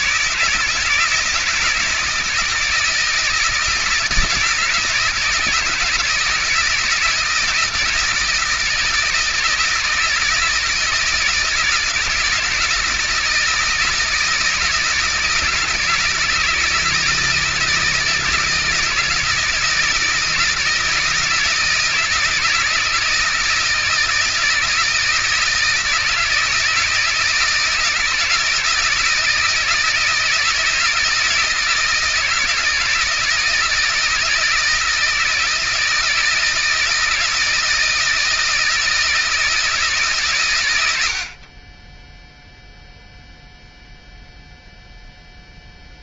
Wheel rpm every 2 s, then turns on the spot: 160, 160, 160, 160, 160, 160, 160, 160, 160, 160, 160, 160, 160, 160, 170, 160, 160, 160, 160, 160, 110, 0, 0.
none